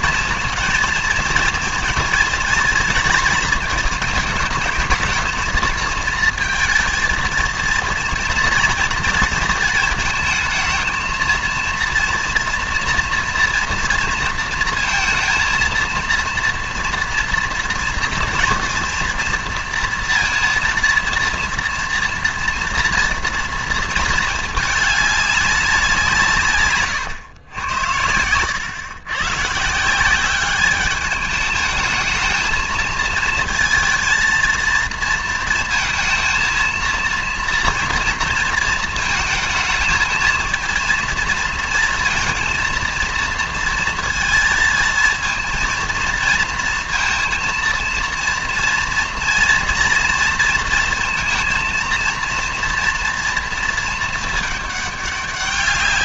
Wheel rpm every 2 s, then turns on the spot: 230, 230, 220, 230, 230, 220, 240, 230, 230, 240, 230, 230, 210, 130, 110, 200, 220, 230, 230, 230, 230, 230, 230, 230, 230, 230, 230, 210.
none